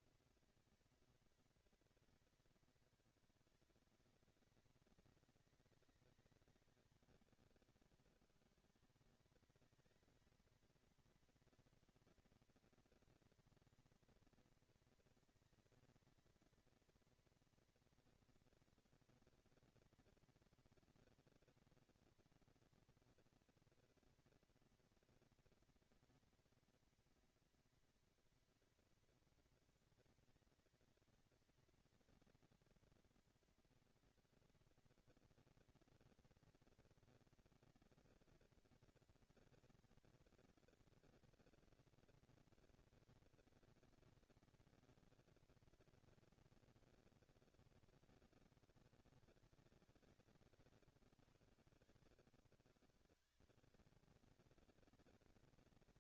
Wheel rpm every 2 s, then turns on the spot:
230, 220, 200, 200, 200, 230, 230, 230, 230, 230, 240, 230, 230, 230, 240, 220, 230, 230, 230, 230, 230, 230, 230, 230, 220, 160, 120, 220.
none